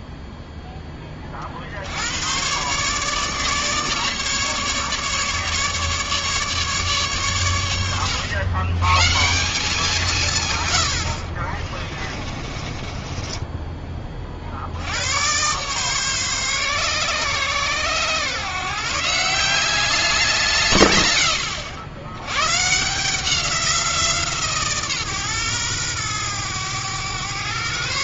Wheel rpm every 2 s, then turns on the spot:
10, 140, 150, 150, 120, 110, 30, 80, 140, 140, 130, 140, 140, 110.
12-14